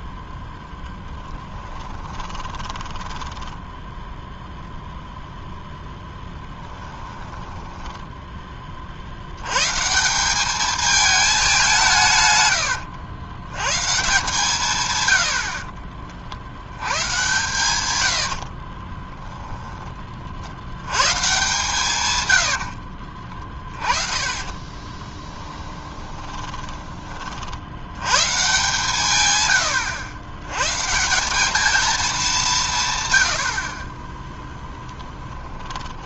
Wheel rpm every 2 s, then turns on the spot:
10, 10, 0, 10, 30, 210, 110, 150, 80, 30, 90, 70, 20, 20, 130, 130, 160, 10.
0-4 6-8 18-20 22-28 34-36